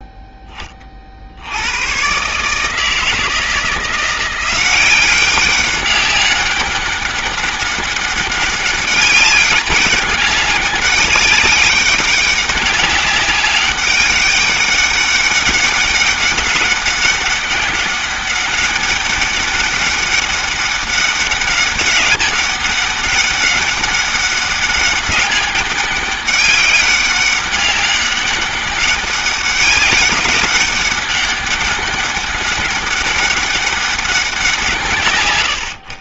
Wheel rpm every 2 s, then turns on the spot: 60, 160, 190, 200, 200, 200, 200, 200, 190, 200, 200, 200, 200, 190, 200, 200, 200, 110.
none